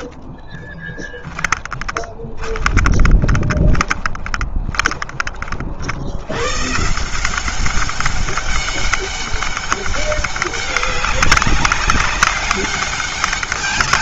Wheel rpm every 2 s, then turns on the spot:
10, 20, 20, 160, 200, 200, 200.
0-4